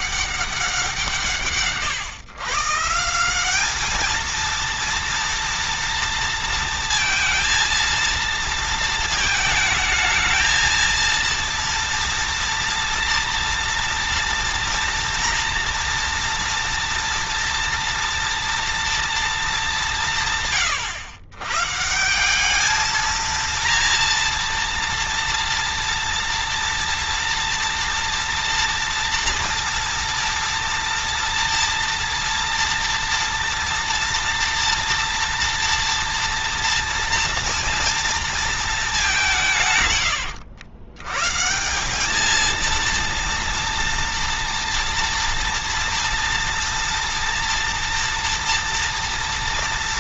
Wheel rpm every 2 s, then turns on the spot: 190, 160, 230, 230, 230, 230, 230, 230, 230, 230, 110, 210, 230, 230, 230, 230, 230, 230, 230, 220, 110, 230, 230, 230, 230.
none